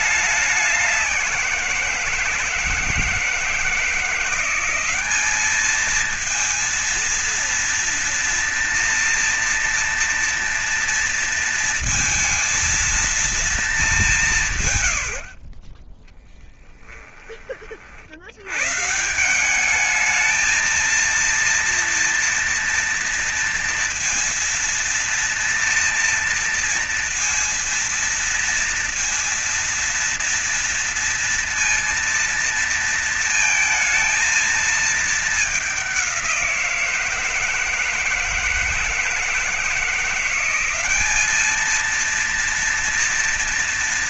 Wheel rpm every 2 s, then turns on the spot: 200, 170, 180, 230, 230, 230, 230, 130, 10, 120, 230, 240, 230, 230, 230, 230, 230, 220, 170, 160, 190, 230.
14-16